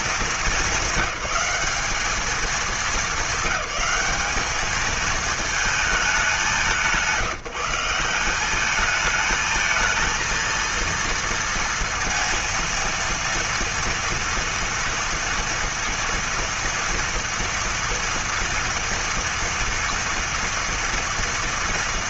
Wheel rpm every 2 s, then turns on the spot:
200, 210, 210, 190, 200, 230, 230, 230, 240, 230, 230.
none